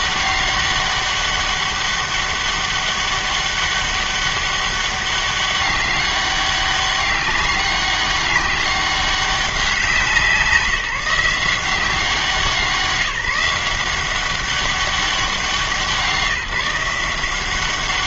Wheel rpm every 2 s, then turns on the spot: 200, 200, 200, 200, 200, 180, 170, 200, 170.
none